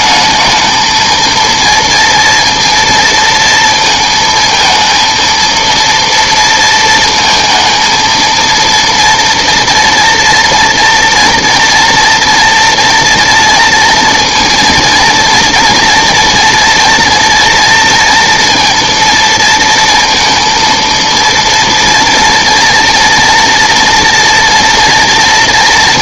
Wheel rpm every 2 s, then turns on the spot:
220, 230, 230, 230, 230, 230, 230, 230, 230, 230, 230, 230, 240.
none